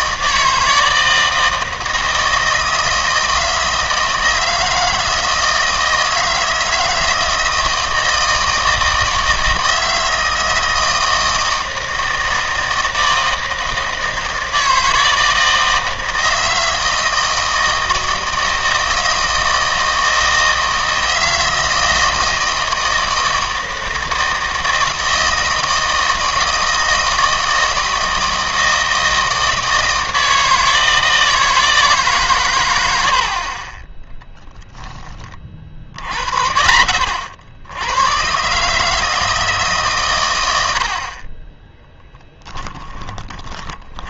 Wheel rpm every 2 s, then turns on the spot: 160, 160, 160, 160, 160, 160, 160, 160, 160, 160, 160, 160, 160, 160, 160, 160, 110, 10, 40, 140, 80, 10.
42-44